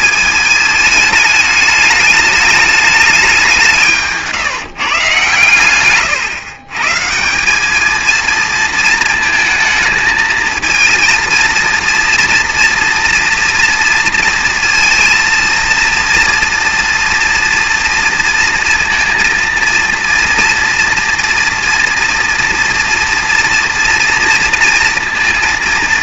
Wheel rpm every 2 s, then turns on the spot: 210, 210, 150, 130, 230, 230, 240, 230, 230, 230, 230, 230, 230.
none